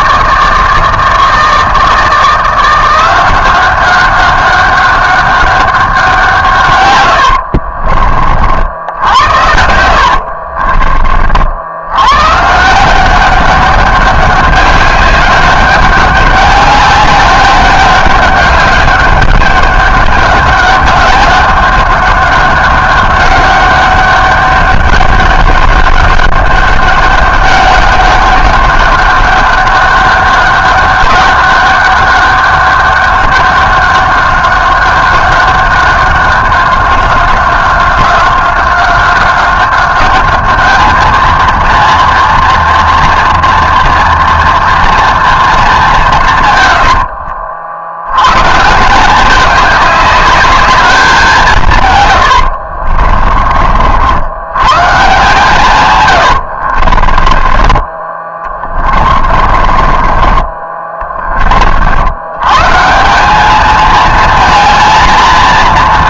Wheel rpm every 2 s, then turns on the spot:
160, 170, 200, 130, 60, 50, 160, 200, 200, 200, 200, 200, 200, 200, 200, 200, 200, 190, 190, 190, 210, 240, 230, 100, 160, 210, 70, 120, 70, 30, 20, 140, 230.
10-12 46-48 52-54 56-60